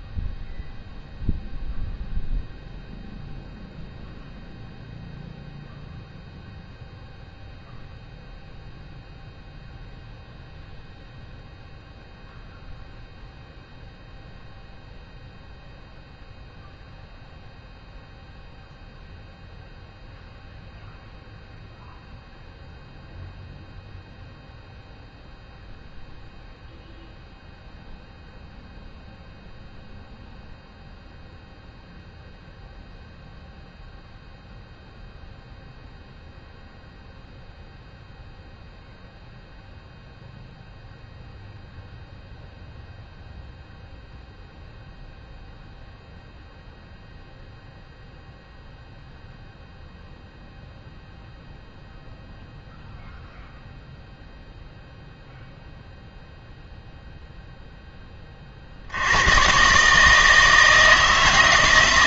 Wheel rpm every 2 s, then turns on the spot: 0, 0, 0, 0, 0, 0, 0, 0, 0, 0, 0, 0, 0, 0, 0, 0, 0, 0, 0, 0, 0, 0, 0, 0, 0, 0, 0, 0, 0, 60, 160.
none